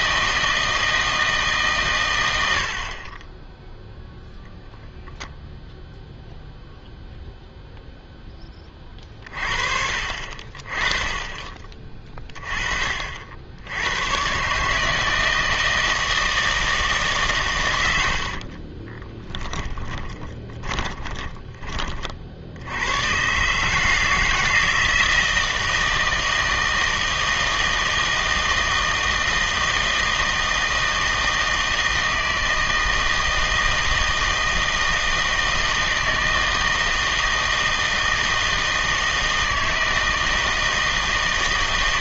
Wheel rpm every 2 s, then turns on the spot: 160, 60, 0, 0, 20, 30, 30, 140, 160, 40, 20, 80, 160, 160, 160, 160, 160, 160, 160, 160, 160.
18-22